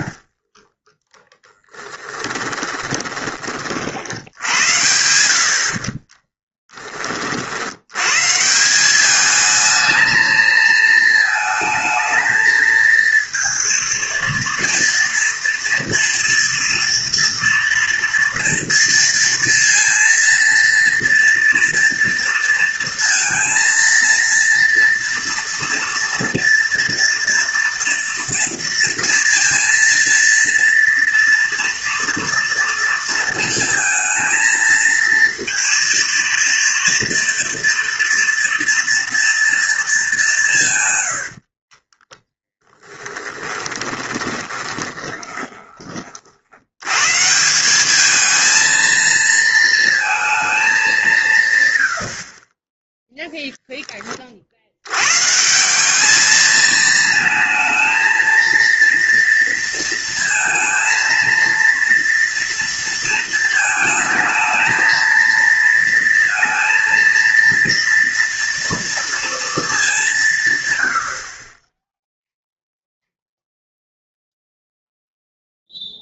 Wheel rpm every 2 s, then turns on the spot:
20, 20, 70, 30, 190, 220, 230, 230, 240, 230, 230, 230, 230, 230, 230, 230, 230, 230, 240, 230, 120, 20, 20, 110, 230, 200, 10, 100, 220, 230, 230, 230, 220, 230, 230, 80, 0, 0.
0-4 42-46